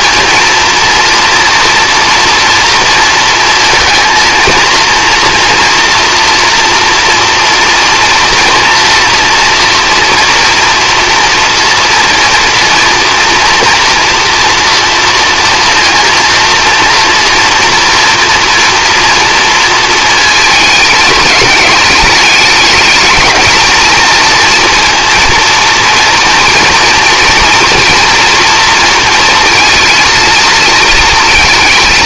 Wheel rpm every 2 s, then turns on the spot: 230, 230, 230, 230, 230, 230, 230, 230, 230, 230, 220, 220, 230, 240, 230, 220.
none